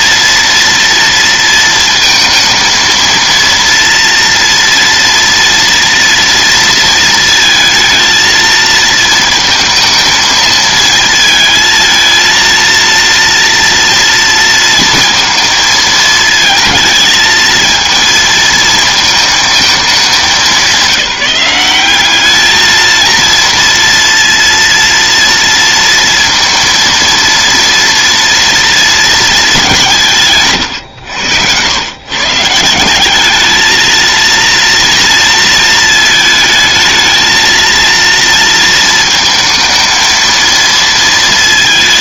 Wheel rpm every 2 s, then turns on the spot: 230, 230, 230, 220, 220, 220, 230, 230, 220, 220, 200, 220, 230, 230, 230, 110, 190, 230, 220, 230, 230.
none